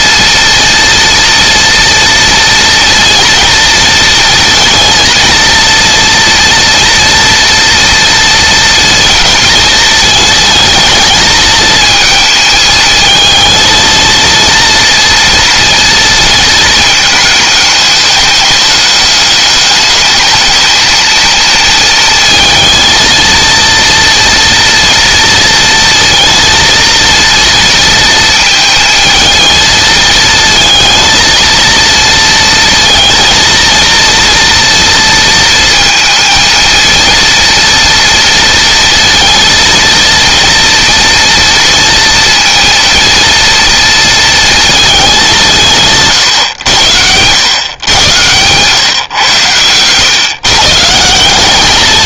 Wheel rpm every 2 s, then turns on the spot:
230, 230, 230, 230, 230, 220, 220, 230, 220, 210, 220, 230, 230, 230, 220, 220, 230, 230, 230, 230, 230, 230, 210, 90, 120, 170.
none